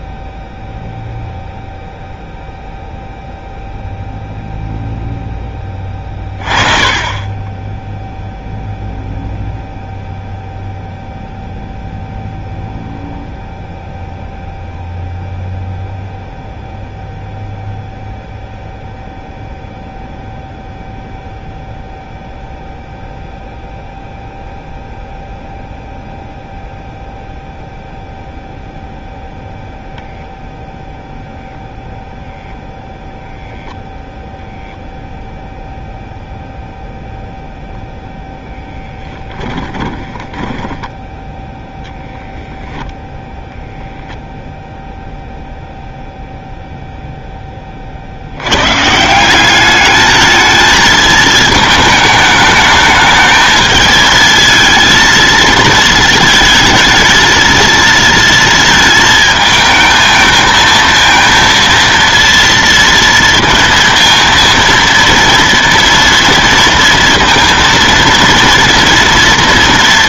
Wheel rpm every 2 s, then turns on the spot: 0, 0, 0, 20, 0, 0, 0, 0, 0, 0, 0, 0, 0, 0, 0, 0, 0, 0, 0, 0, 10, 0, 0, 0, 120, 220, 210, 230, 220, 230, 220, 230, 230, 230, 230.
40-42